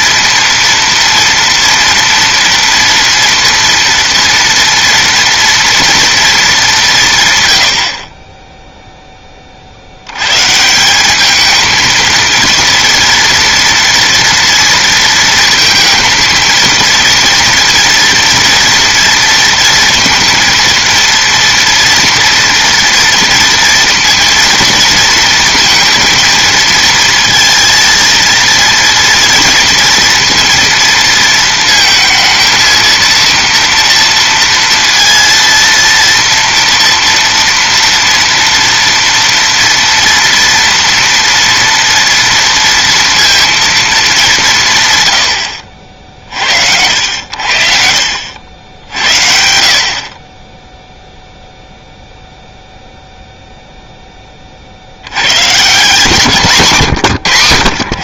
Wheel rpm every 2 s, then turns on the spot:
240, 230, 230, 220, 20, 120, 230, 230, 220, 230, 230, 230, 230, 230, 230, 230, 230, 230, 230, 230, 230, 230, 170, 70, 80, 20, 0, 30, 160.
none